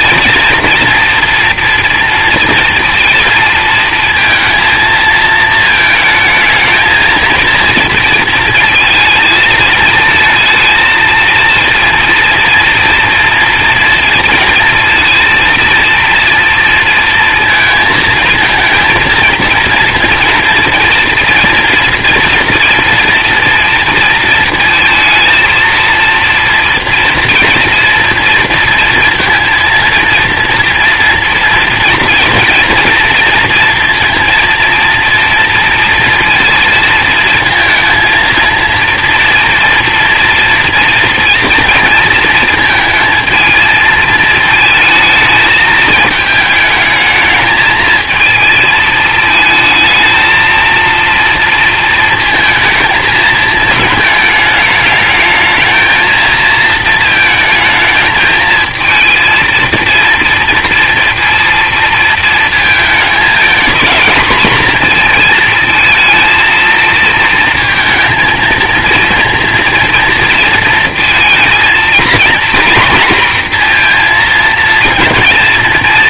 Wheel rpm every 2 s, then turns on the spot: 240, 230, 230, 220, 230, 220, 230, 230, 230, 230, 230, 230, 230, 230, 230, 240, 230, 230, 230, 230, 230, 220, 220, 210, 220, 220, 220, 220, 220, 220, 240, 220, 230, 220, 230, 230, 230, 230.
none